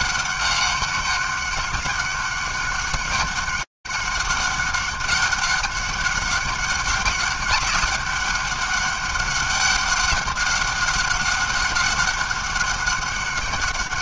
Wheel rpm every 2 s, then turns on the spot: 200, 200, 200, 200, 200, 190, 200.
none